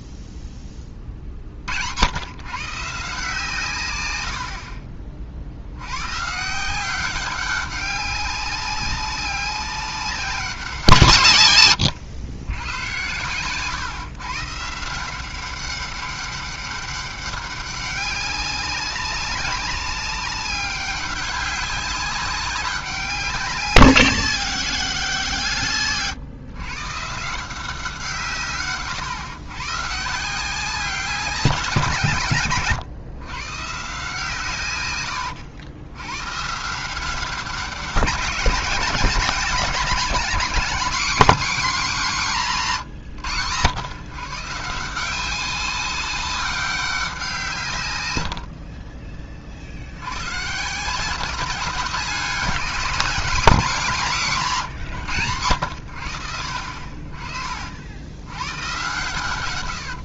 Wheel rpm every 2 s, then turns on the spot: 30, 150, 40, 180, 190, 170, 100, 160, 200, 200, 200, 190, 190, 140, 130, 190, 130, 120, 160, 190, 210, 170, 170, 190, 50, 170, 210, 150, 50, 110.
4-6 48-50